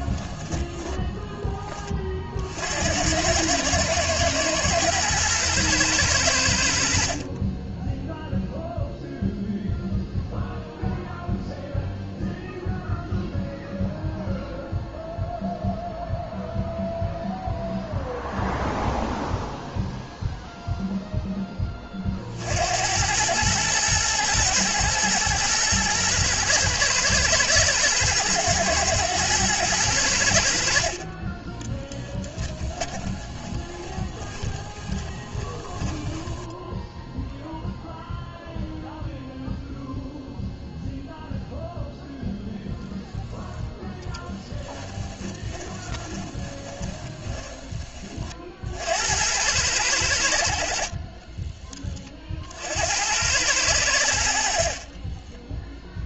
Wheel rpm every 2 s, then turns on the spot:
10, 80, 120, 60, 0, 0, 0, 0, 0, 0, 0, 90, 120, 120, 110, 40, 30, 20, 0, 0, 0, 0, 20, 20, 70, 40, 80, 30.
30-36 44-48 54-56